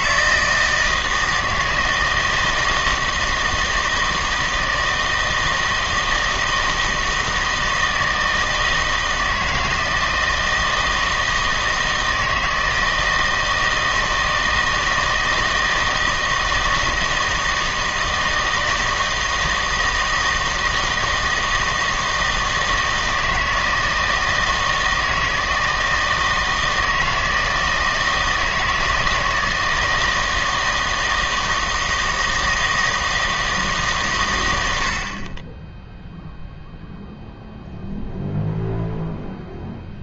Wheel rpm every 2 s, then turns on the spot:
160, 160, 160, 160, 160, 160, 160, 160, 160, 160, 160, 160, 160, 160, 160, 160, 160, 80, 0, 0.
none